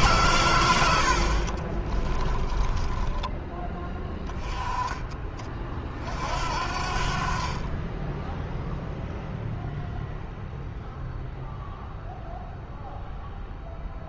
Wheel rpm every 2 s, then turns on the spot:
100, 20, 20, 50, 0, 0, 0.
2-4